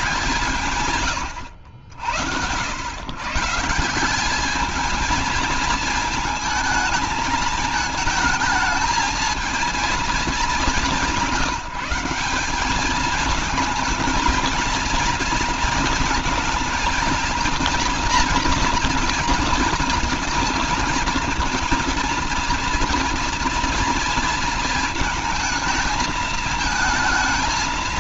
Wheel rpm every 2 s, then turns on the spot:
150, 100, 210, 220, 220, 200, 210, 220, 230, 230, 230, 230, 230, 220.
none